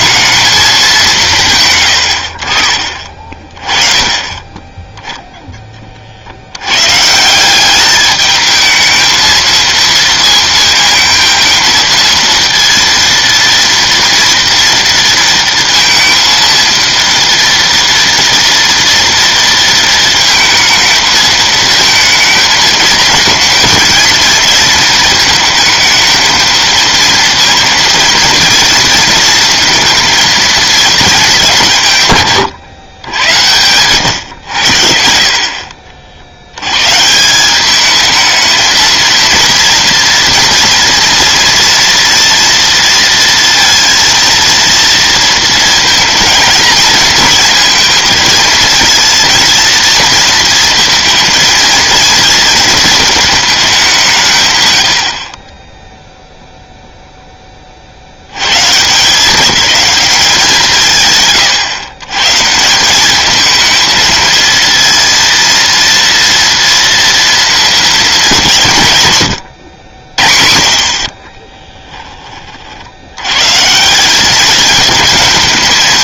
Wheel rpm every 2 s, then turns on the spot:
220, 50, 10, 110, 220, 230, 230, 230, 230, 230, 220, 220, 230, 230, 230, 230, 120, 90, 120, 220, 230, 230, 230, 230, 230, 230, 220, 110, 0, 140, 170, 170, 230, 230, 160, 40, 70, 210.
none